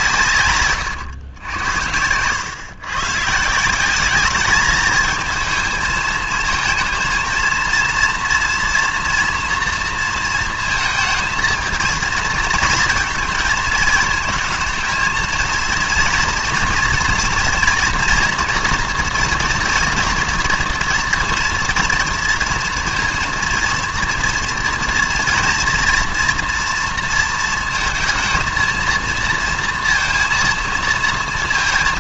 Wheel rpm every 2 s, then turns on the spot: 120, 120, 210, 230, 230, 230, 220, 220, 230, 240, 230, 230, 230, 230, 230, 230.
none